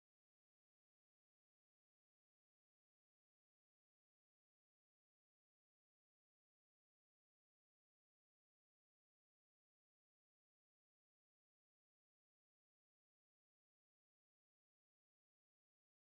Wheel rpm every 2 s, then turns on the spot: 0, 0, 0, 0, 0, 0, 0, 0.
none